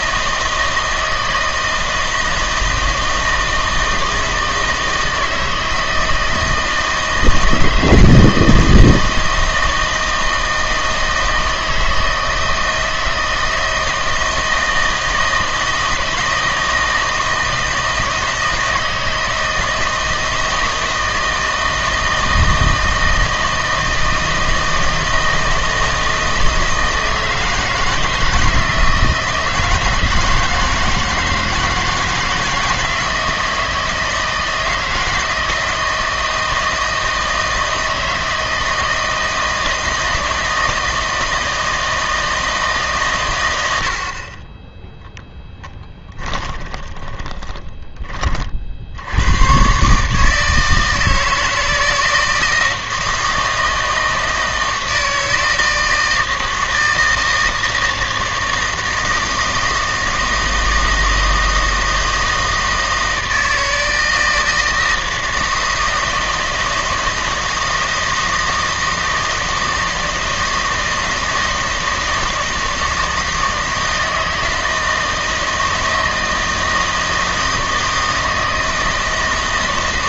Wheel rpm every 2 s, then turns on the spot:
160, 160, 160, 160, 160, 160, 160, 160, 160, 160, 160, 160, 160, 160, 160, 160, 160, 160, 160, 160, 160, 150, 10, 20, 60, 160, 160, 160, 160, 160, 160, 160, 160, 160, 160, 160, 160, 160, 160, 160.
46-48